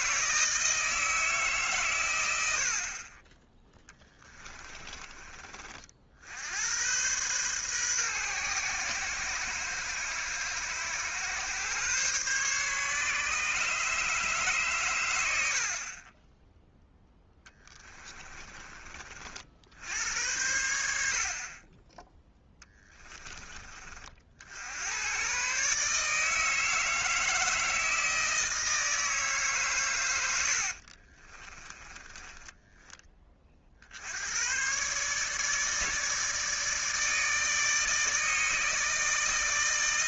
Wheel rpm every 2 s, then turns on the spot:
160, 70, 20, 80, 120, 110, 140, 140, 10, 20, 80, 10, 70, 160, 160, 90, 10, 110, 160, 160.
4-6 18-20 30-34